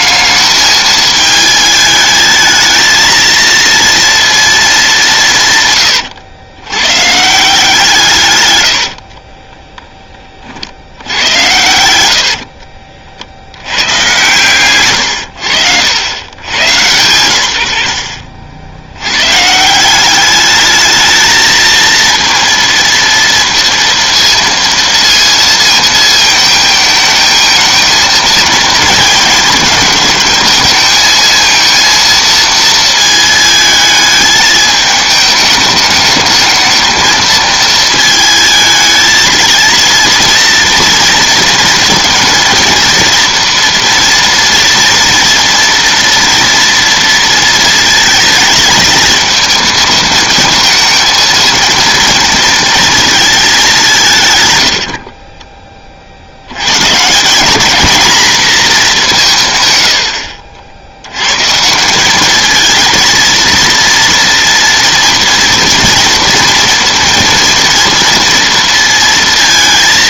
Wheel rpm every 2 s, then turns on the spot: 210, 220, 220, 120, 100, 50, 50, 120, 110, 60, 210, 230, 230, 220, 230, 220, 230, 210, 220, 220, 230, 230, 240, 230, 220, 230, 230, 100, 120, 220, 70, 220, 230, 230, 230.
8-10 12-14 54-56